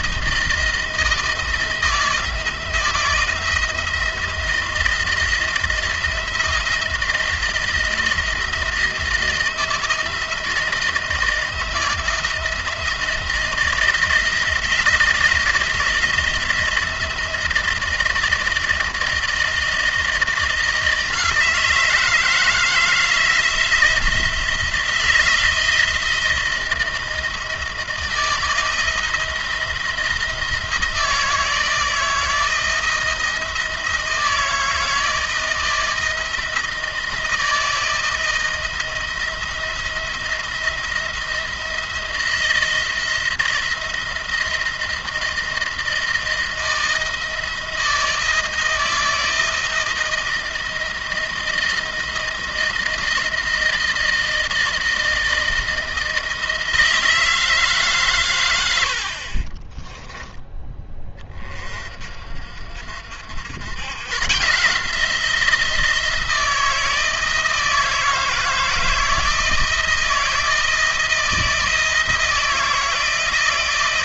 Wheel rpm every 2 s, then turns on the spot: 160, 170, 170, 170, 160, 160, 170, 170, 170, 170, 160, 160, 170, 170, 160, 160, 160, 160, 160, 170, 170, 170, 170, 160, 160, 160, 160, 160, 160, 90, 10, 60, 150, 160, 160, 160, 160.
none